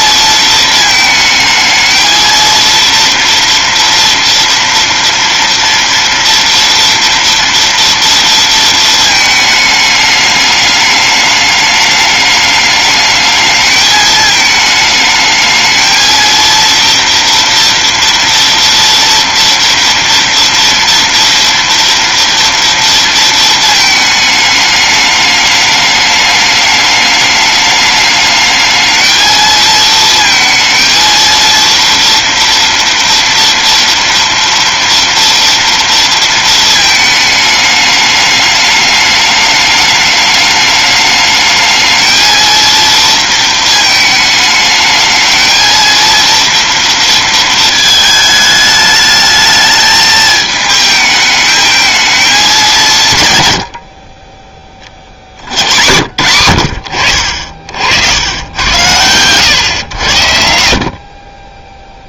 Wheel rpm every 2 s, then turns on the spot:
220, 240, 230, 230, 220, 210, 220, 220, 230, 240, 230, 230, 210, 210, 220, 230, 230, 230, 210, 210, 220, 230, 220, 230, 220, 220, 100, 80, 70, 120, 20.
none